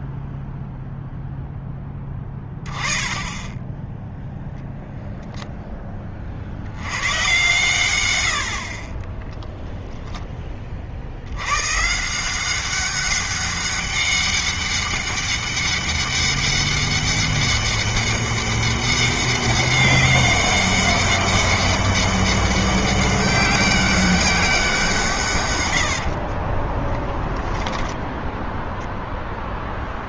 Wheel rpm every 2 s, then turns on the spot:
0, 30, 0, 90, 40, 60, 190, 200, 200, 200, 200, 200, 170, 20, 10.
8-10 26-28